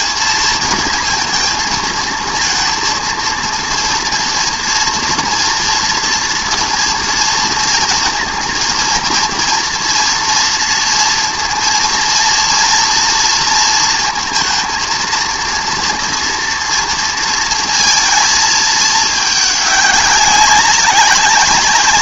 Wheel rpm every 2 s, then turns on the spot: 230, 230, 230, 230, 230, 230, 230, 230, 230, 220, 190.
none